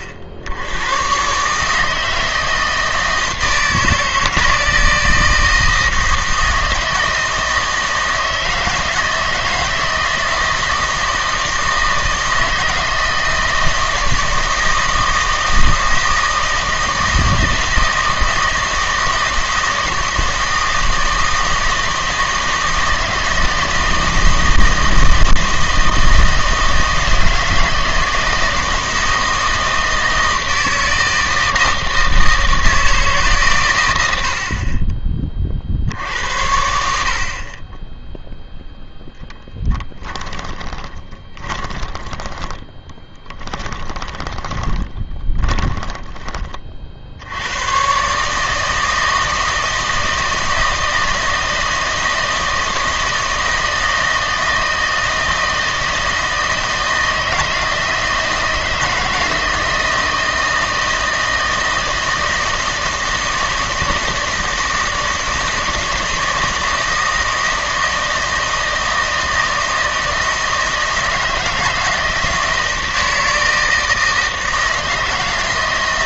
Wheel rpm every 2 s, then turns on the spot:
70, 160, 160, 160, 160, 160, 160, 160, 160, 160, 160, 160, 160, 160, 160, 160, 160, 40, 70, 0, 20, 20, 20, 30, 160, 160, 160, 160, 160, 160, 160, 160, 160, 160, 160, 160, 160, 160.
40-46